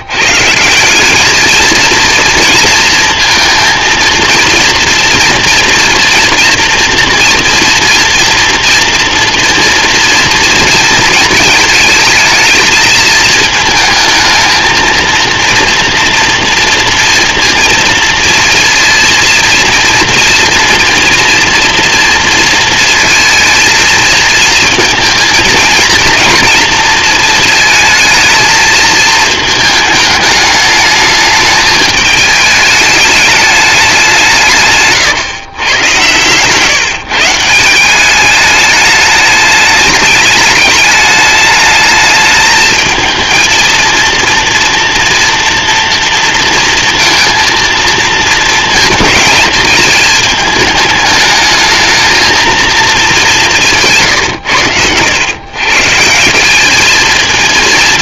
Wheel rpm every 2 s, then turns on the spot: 130, 220, 230, 230, 230, 230, 220, 220, 230, 230, 230, 240, 230, 230, 220, 220, 220, 200, 110, 180, 210, 220, 230, 230, 230, 220, 220, 170, 130.
none